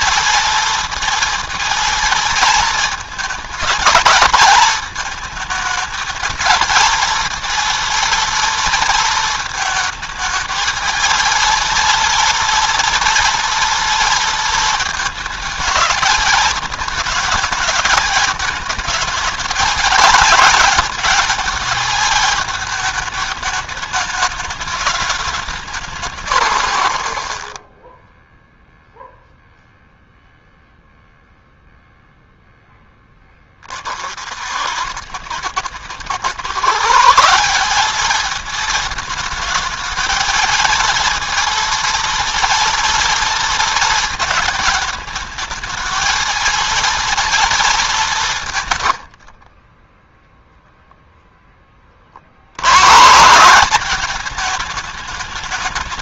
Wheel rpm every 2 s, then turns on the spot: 230, 220, 220, 230, 220, 220, 230, 220, 220, 210, 220, 220, 210, 100, 0, 0, 10, 90, 160, 220, 230, 230, 220, 230, 100, 0, 130, 220.
48-50